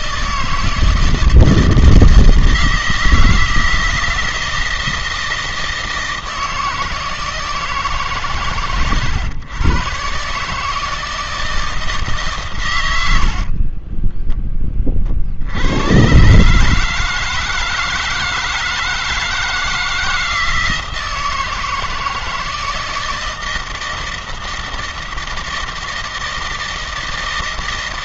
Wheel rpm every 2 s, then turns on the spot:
160, 170, 160, 160, 130, 150, 120, 20, 150, 160, 160, 160, 160, 160.
none